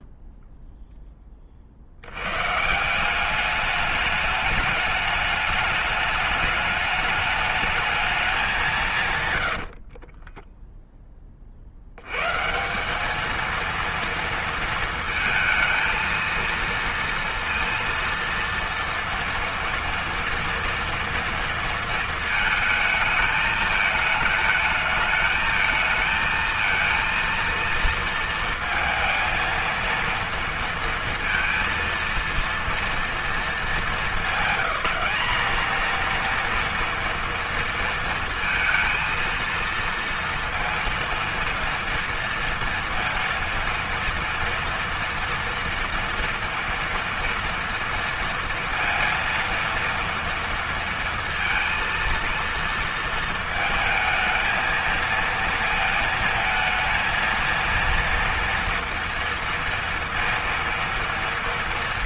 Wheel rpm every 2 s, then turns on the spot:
0, 130, 210, 210, 190, 10, 140, 230, 230, 230, 230, 220, 220, 220, 230, 230, 230, 180, 240, 230, 230, 230, 230, 230, 230, 230, 230, 220, 220, 230, 230.
10-12